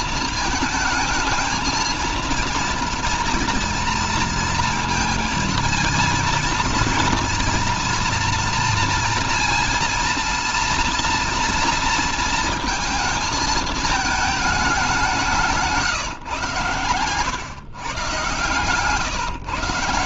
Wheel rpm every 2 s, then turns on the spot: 220, 230, 230, 230, 230, 230, 220, 190, 120, 120.
none